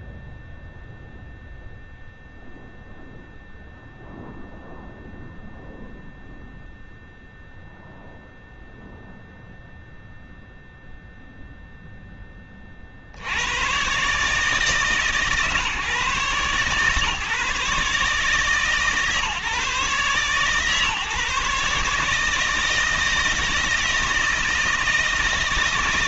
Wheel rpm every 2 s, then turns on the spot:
0, 0, 0, 0, 0, 0, 40, 150, 140, 150, 140, 160, 160.
none